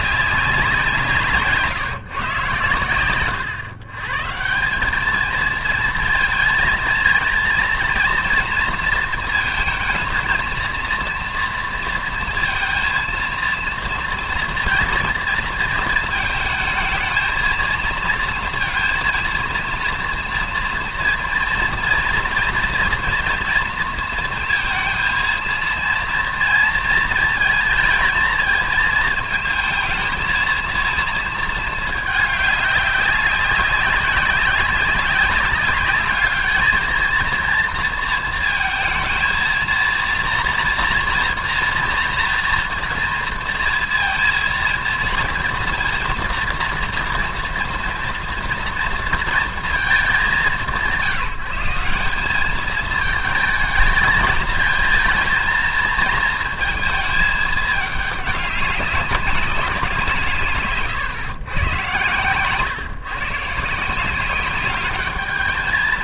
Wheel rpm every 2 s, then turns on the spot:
180, 120, 200, 230, 230, 230, 230, 240, 220, 230, 230, 230, 230, 230, 220, 230, 200, 190, 220, 230, 240, 230, 230, 230, 230, 180, 220, 230, 220, 200, 130, 130, 200.
none